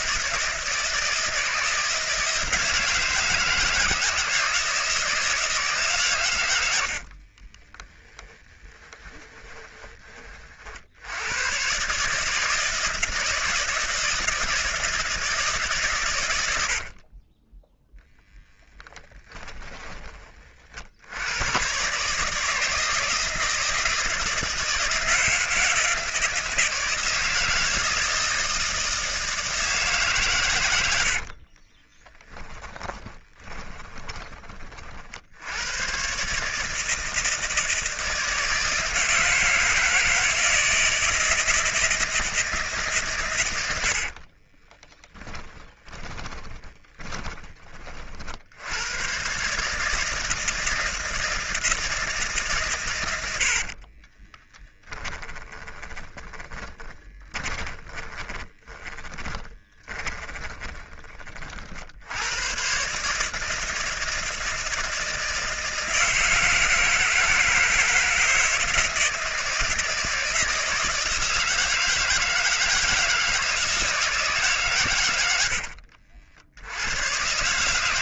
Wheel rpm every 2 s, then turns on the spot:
160, 160, 160, 70, 10, 80, 160, 160, 70, 10, 70, 160, 160, 160, 160, 90, 20, 50, 160, 160, 160, 150, 20, 30, 110, 160, 120, 10, 20, 30, 30, 130, 160, 160, 160, 160, 160, 110, 90.
6-10 16-20 30-34 44-48 54-60